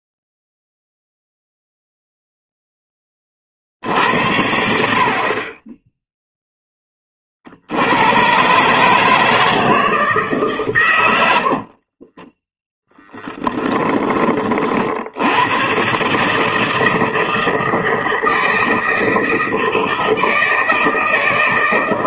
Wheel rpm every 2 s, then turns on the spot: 0, 0, 70, 10, 140, 130, 10, 40, 160, 160, 160.
12-14